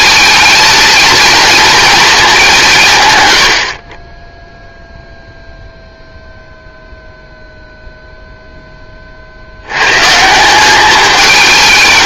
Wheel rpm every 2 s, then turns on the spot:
220, 160, 0, 0, 10, 200.
none